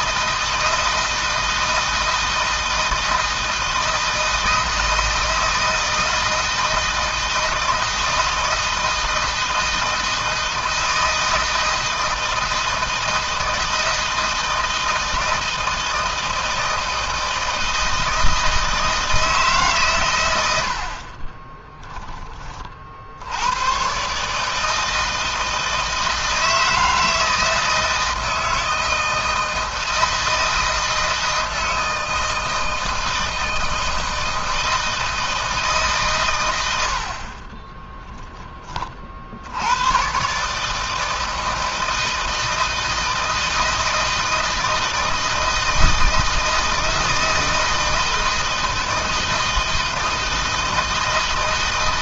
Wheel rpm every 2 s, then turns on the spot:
160, 160, 160, 160, 160, 160, 160, 160, 160, 160, 50, 50, 160, 160, 160, 160, 160, 160, 90, 60, 160, 160, 160, 160, 160, 160.
none